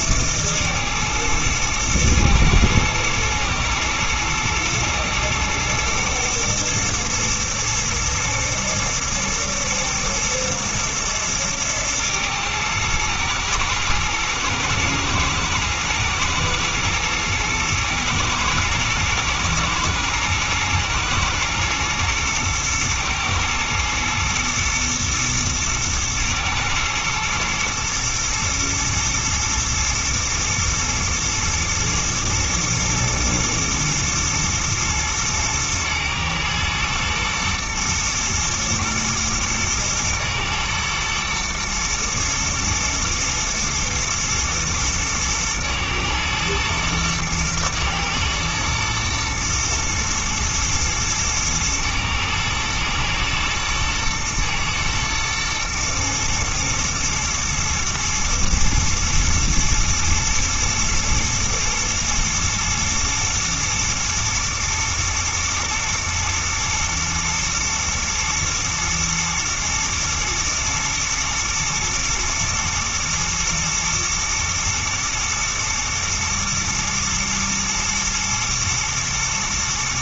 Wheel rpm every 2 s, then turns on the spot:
110, 110, 110, 120, 120, 110, 110, 110, 120, 120, 120, 110, 120, 110, 110, 110, 110, 110, 110, 120, 110, 110, 110, 110, 110, 110, 110, 110, 120, 110, 110, 110, 110, 120, 110, 120, 110, 110, 110, 120.
none